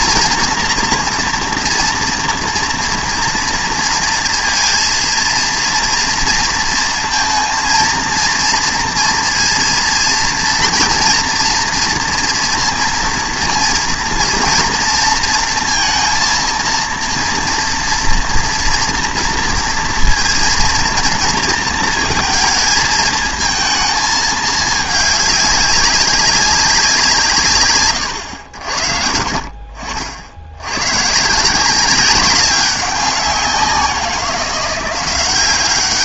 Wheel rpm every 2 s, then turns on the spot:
240, 230, 230, 230, 230, 230, 230, 230, 230, 240, 230, 220, 210, 190, 70, 110, 190, 180.
none